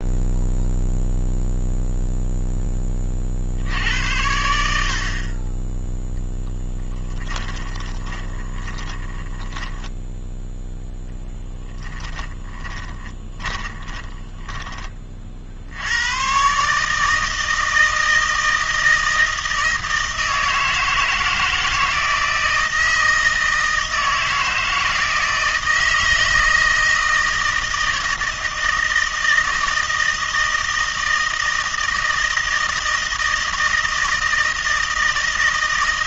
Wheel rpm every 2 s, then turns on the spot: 0, 10, 80, 10, 20, 0, 20, 20, 140, 160, 160, 160, 160, 160, 160, 160, 160, 160.
8-10 12-14